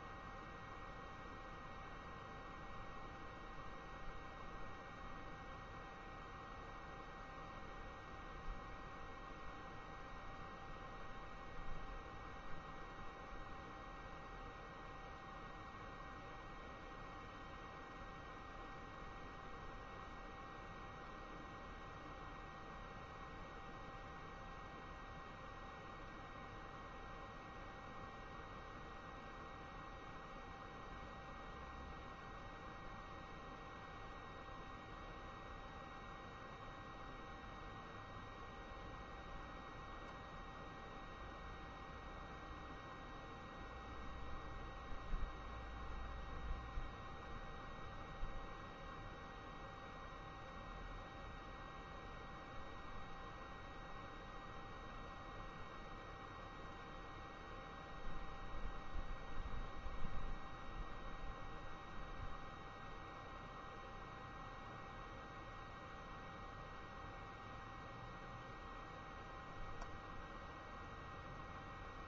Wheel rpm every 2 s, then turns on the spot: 0, 0, 0, 0, 0, 0, 0, 0, 0, 0, 0, 0, 0, 0, 0, 0, 0, 0, 0, 0, 0, 0, 0, 0, 0, 0, 0, 0, 0, 0, 0, 0, 0, 0, 0, 0.
none